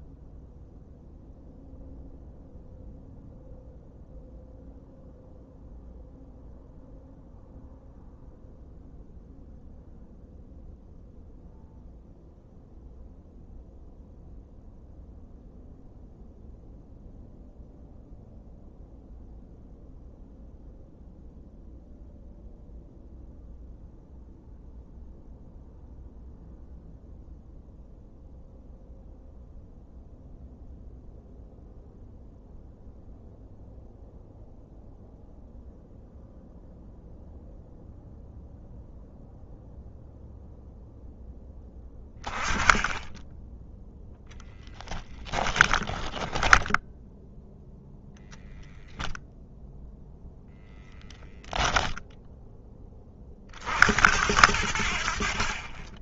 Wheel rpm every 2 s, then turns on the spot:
0, 0, 0, 0, 0, 0, 0, 0, 0, 0, 0, 0, 0, 0, 0, 0, 0, 0, 0, 0, 0, 20, 0, 10, 0, 0, 10, 80.
46-48